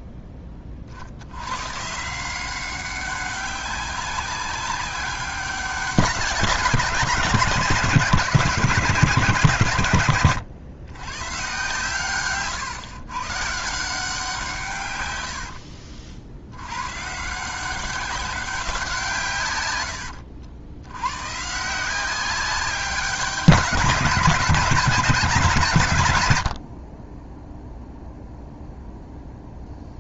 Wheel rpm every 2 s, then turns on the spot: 50, 190, 200, 170, 160, 120, 130, 120, 130, 160, 100, 190, 190, 40, 0.
none